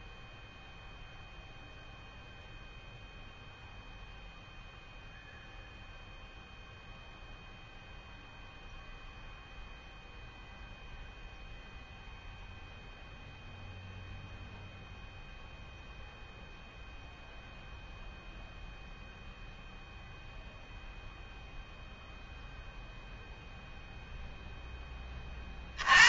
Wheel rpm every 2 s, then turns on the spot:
0, 0, 0, 0, 0, 0, 0, 0, 0, 0, 0, 0, 10.
none